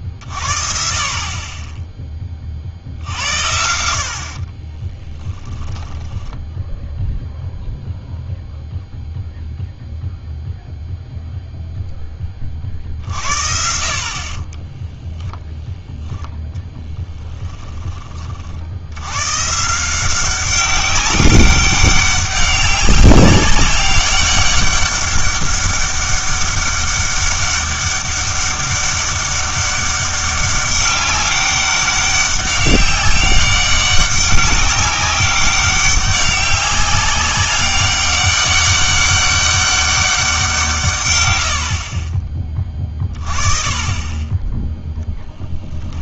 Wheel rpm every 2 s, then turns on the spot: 50, 50, 40, 10, 0, 0, 30, 20, 10, 70, 200, 200, 200, 200, 200, 200, 200, 200, 200, 200, 160, 20, 10.
4-6 14-18